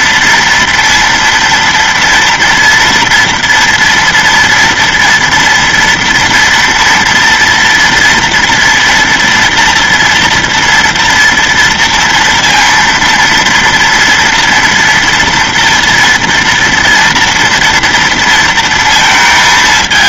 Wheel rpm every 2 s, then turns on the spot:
230, 230, 230, 230, 230, 230, 230, 230, 240, 230.
none